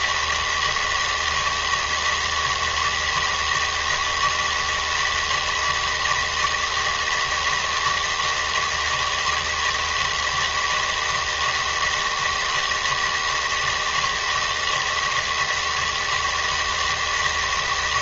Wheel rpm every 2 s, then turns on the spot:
160, 160, 160, 160, 160, 160, 160, 160, 160.
none